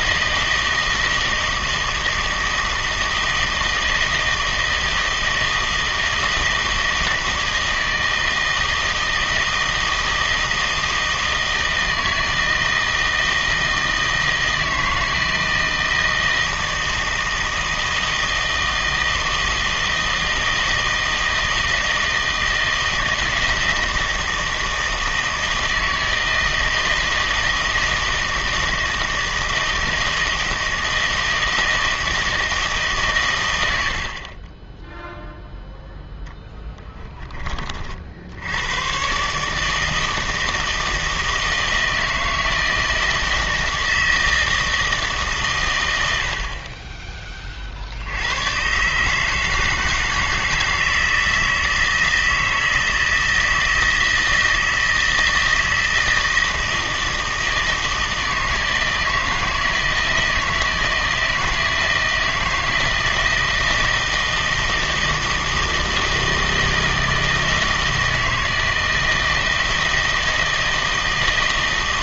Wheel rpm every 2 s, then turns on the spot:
160, 160, 160, 160, 160, 160, 160, 160, 160, 160, 160, 160, 160, 160, 160, 160, 160, 20, 10, 100, 160, 160, 160, 40, 120, 160, 160, 160, 160, 160, 160, 160, 160, 160, 160, 160.
none